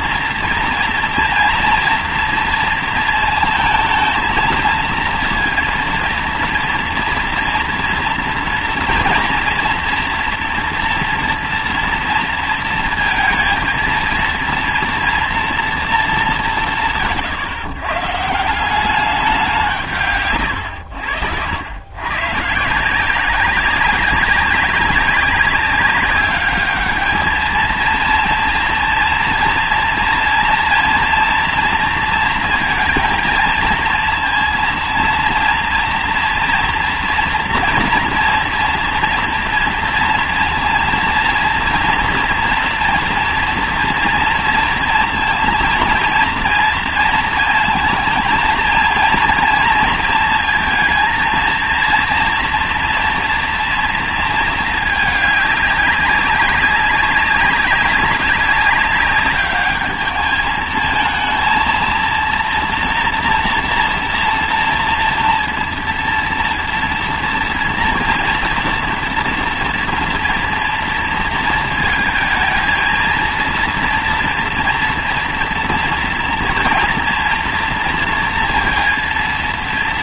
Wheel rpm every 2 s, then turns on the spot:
230, 230, 230, 230, 230, 230, 230, 230, 150, 180, 120, 150, 190, 210, 230, 230, 230, 230, 230, 230, 230, 240, 230, 230, 220, 230, 240, 220, 200, 190, 220, 240, 240, 230, 230, 230, 220, 230, 230, 230.
none